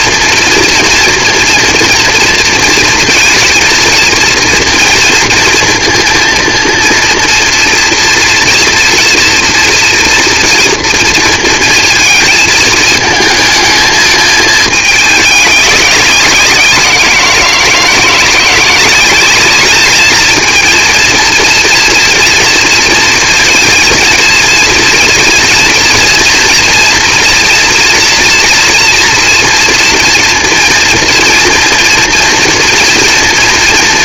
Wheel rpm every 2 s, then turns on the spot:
230, 230, 230, 240, 230, 230, 220, 220, 180, 180, 230, 230, 230, 230, 230, 230, 240.
none